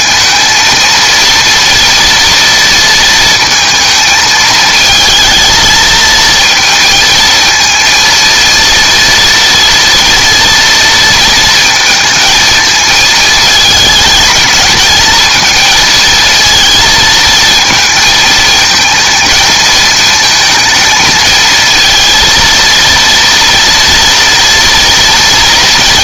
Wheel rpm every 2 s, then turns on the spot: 230, 230, 220, 230, 230, 230, 220, 220, 230, 230, 230, 230, 230.
none